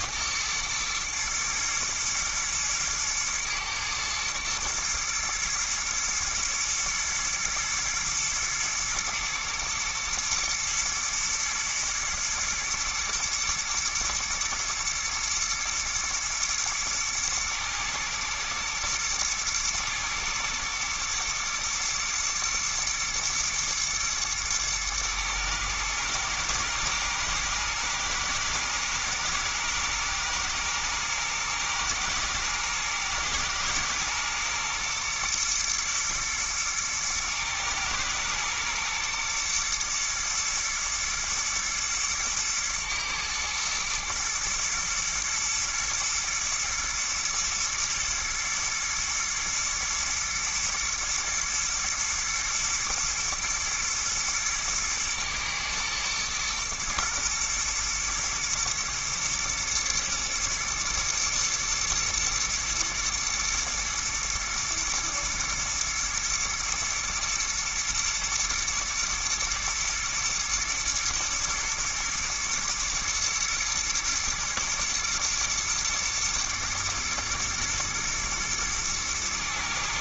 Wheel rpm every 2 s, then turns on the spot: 120, 110, 120, 110, 110, 120, 110, 120, 120, 110, 110, 110, 110, 110, 120, 110, 110, 110, 110, 110, 120, 120, 120, 120, 120, 110, 110, 110, 120, 110, 120, 110, 120, 120, 110, 110, 110, 110, 110, 110.
none